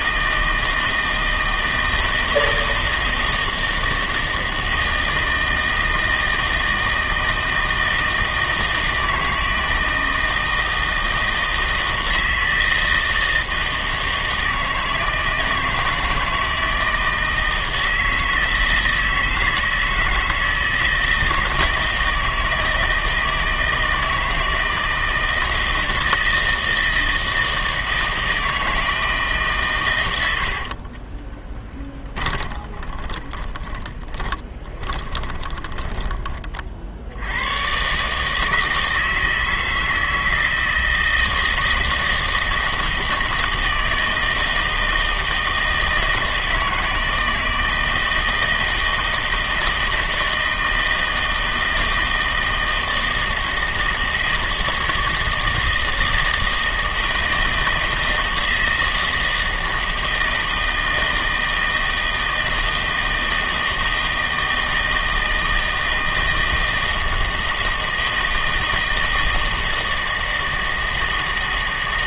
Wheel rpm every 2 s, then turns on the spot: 160, 160, 160, 160, 160, 160, 160, 160, 160, 160, 160, 160, 160, 160, 160, 60, 20, 10, 30, 160, 160, 160, 160, 160, 160, 160, 160, 160, 160, 160, 160, 160, 160, 160, 160, 160.
30-36